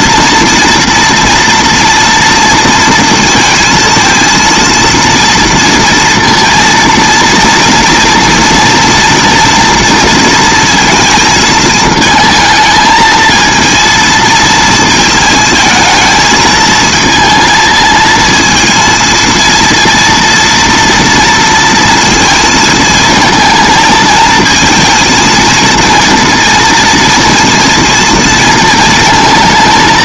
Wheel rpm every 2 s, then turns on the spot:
230, 230, 230, 230, 230, 230, 220, 220, 220, 230, 230, 230, 230, 230, 220.
none